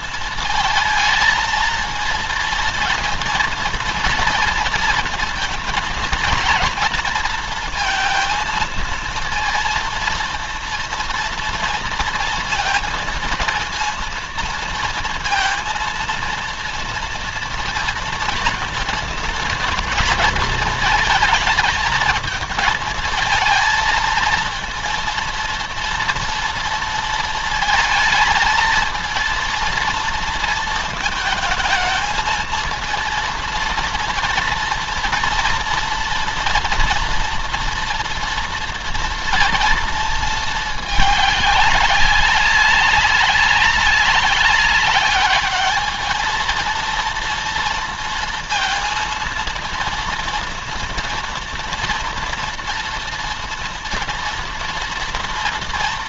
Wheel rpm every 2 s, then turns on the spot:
230, 230, 230, 230, 230, 230, 230, 230, 230, 230, 230, 220, 230, 230, 220, 220, 230, 230, 230, 230, 220, 200, 200, 230, 230, 230, 230, 230.
none